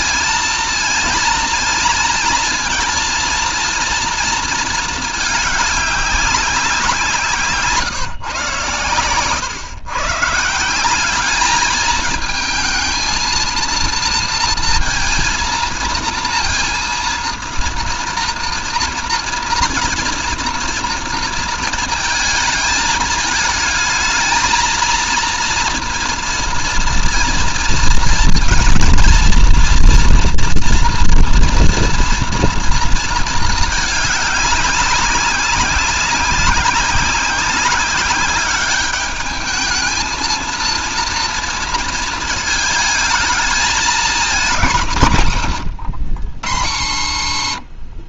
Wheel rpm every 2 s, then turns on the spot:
230, 230, 220, 170, 120, 190, 230, 230, 230, 230, 230, 220, 230, 230, 230, 230, 220, 190, 190, 210, 230, 220, 140, 70.
none